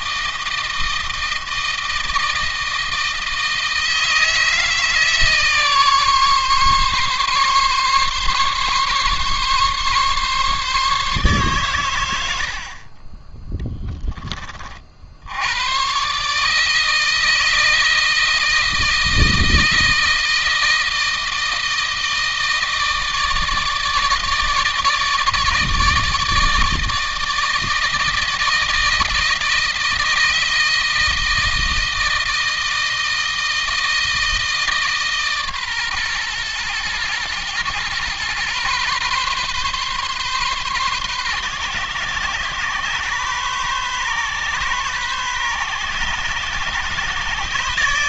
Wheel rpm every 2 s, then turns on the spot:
160, 160, 160, 140, 140, 140, 40, 50, 160, 160, 160, 160, 160, 160, 160, 160, 160, 150, 110, 130, 130, 130, 140, 140.
none